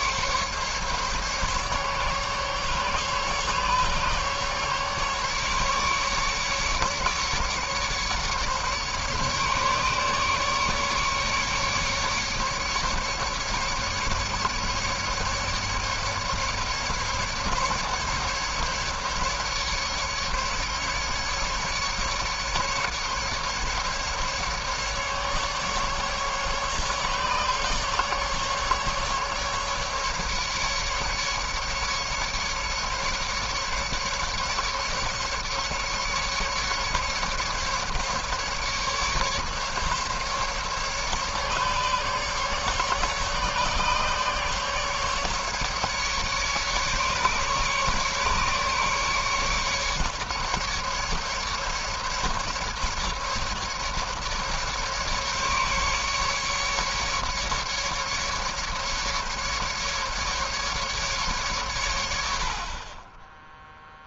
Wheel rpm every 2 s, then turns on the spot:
140, 140, 140, 140, 150, 150, 140, 150, 150, 150, 150, 140, 140, 140, 150, 150, 140, 150, 150, 150, 150, 140, 150, 140, 150, 150, 150, 140, 140, 150, 140, 30.
none